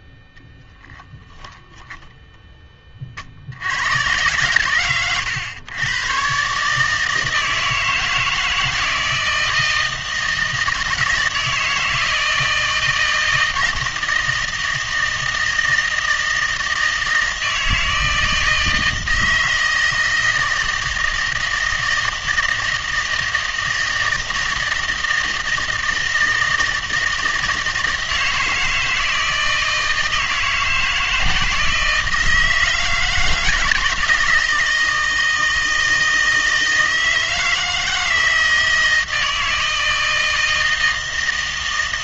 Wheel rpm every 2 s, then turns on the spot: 10, 20, 120, 140, 160, 160, 160, 160, 160, 160, 160, 160, 160, 160, 160, 160, 160, 160, 160, 160, 160.
0-2